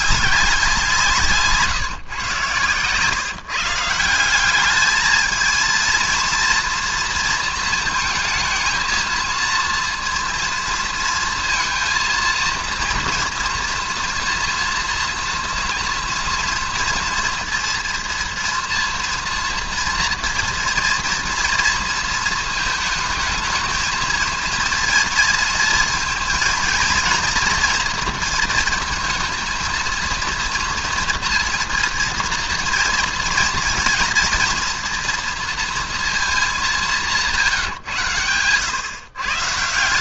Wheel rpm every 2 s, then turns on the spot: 180, 130, 200, 230, 230, 230, 230, 230, 230, 230, 240, 220, 230, 230, 220, 230, 230, 230, 200, 120.
2-4